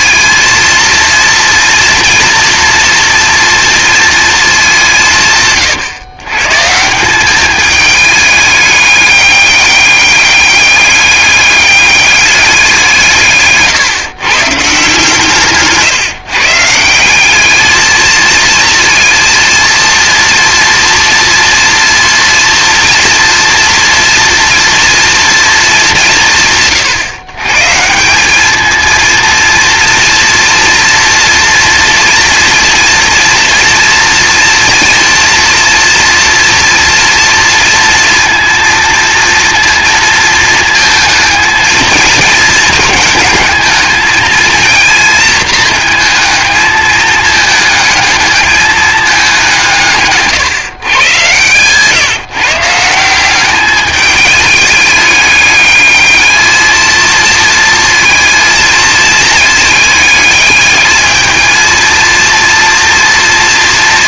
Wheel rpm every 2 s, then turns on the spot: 230, 240, 180, 160, 210, 210, 180, 140, 160, 230, 230, 230, 240, 110, 220, 230, 230, 230, 230, 230, 230, 220, 230, 220, 210, 130, 160, 210, 220, 220, 210, 230.
none